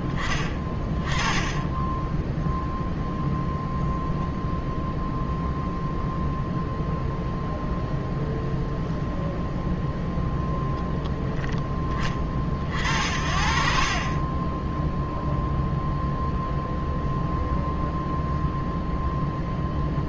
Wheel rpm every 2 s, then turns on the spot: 20, 0, 0, 0, 0, 0, 50, 10, 0, 0.
none